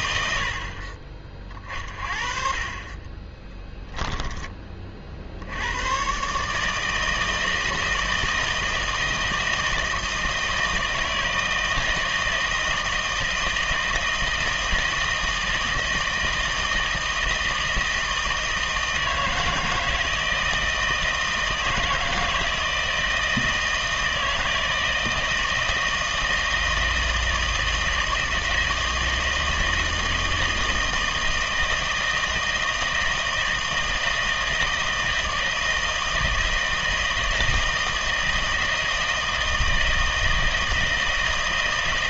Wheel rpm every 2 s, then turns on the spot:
40, 40, 40, 160, 160, 160, 160, 160, 160, 160, 160, 160, 160, 160, 160, 160, 160, 160, 160, 160, 160.
2-4